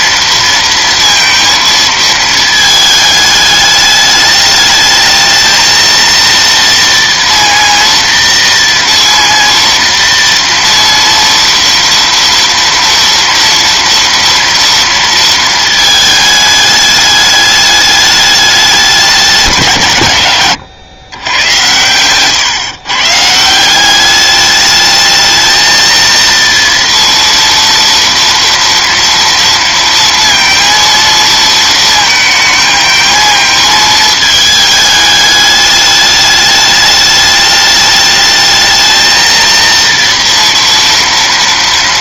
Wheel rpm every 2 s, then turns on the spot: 230, 220, 210, 230, 230, 230, 230, 230, 210, 200, 120, 140, 210, 230, 230, 230, 220, 210, 210, 220, 230.
none